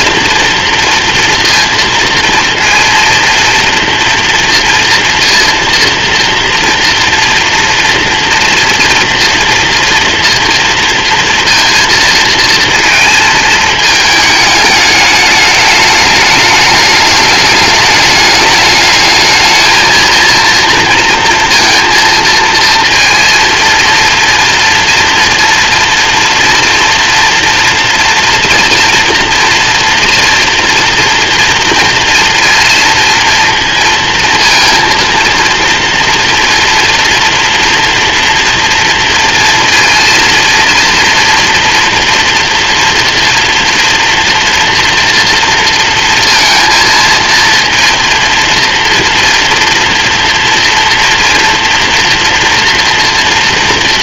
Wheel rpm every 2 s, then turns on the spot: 230, 230, 230, 230, 230, 230, 220, 210, 210, 210, 230, 230, 240, 240, 240, 230, 230, 230, 230, 230, 230, 230, 230, 230, 230, 230, 240.
none